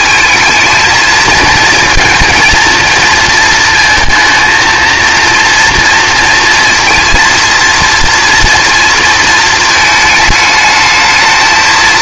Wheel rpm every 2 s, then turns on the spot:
220, 230, 230, 230, 230, 220.
none